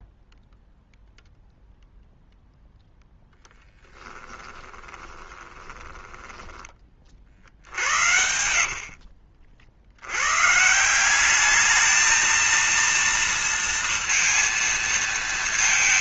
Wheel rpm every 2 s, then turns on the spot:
0, 0, 10, 20, 60, 130, 230, 230.
4-10